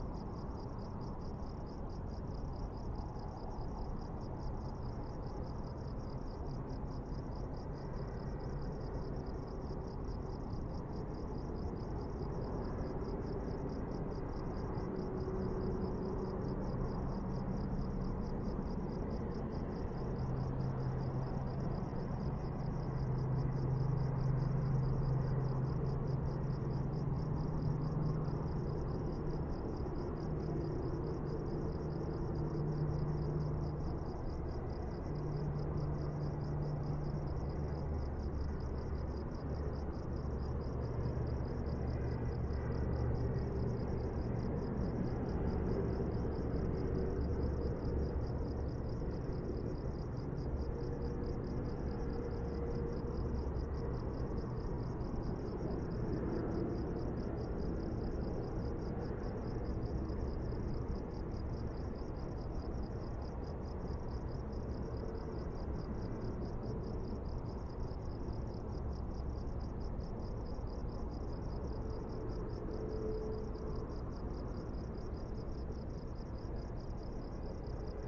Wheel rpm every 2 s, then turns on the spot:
0, 0, 0, 0, 0, 0, 0, 0, 0, 0, 0, 0, 0, 0, 0, 0, 0, 0, 0, 0, 0, 0, 0, 0, 0, 0, 0, 0, 0, 0, 0, 0, 0, 0, 0, 0, 0, 0, 0.
none